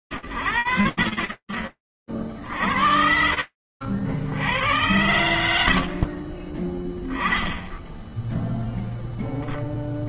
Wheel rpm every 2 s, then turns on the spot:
40, 60, 80, 0, 0.
none